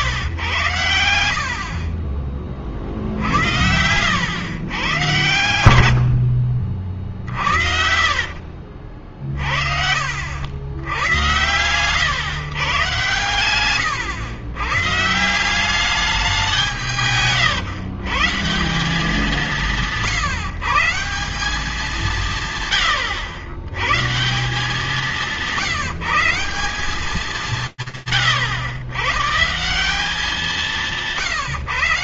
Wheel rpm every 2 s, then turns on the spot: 100, 40, 110, 50, 50, 70, 130, 130, 160, 170, 160, 120, 190, 180, 110, 180.
2-4 6-10